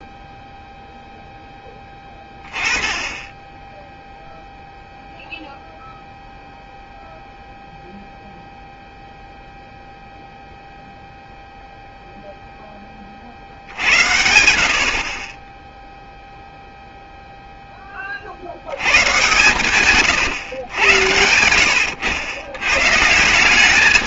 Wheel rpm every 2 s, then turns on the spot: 0, 20, 0, 0, 0, 0, 10, 70, 0, 90, 110, 120.
none